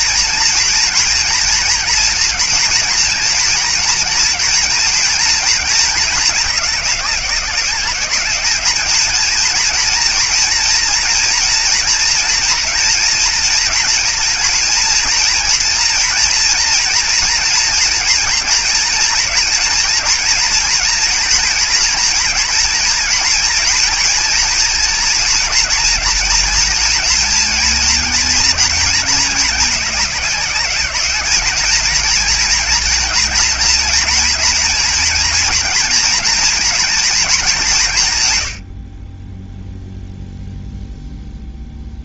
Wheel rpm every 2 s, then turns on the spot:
230, 230, 230, 200, 210, 230, 240, 230, 230, 230, 230, 230, 230, 230, 220, 200, 230, 230, 220, 40, 0.
none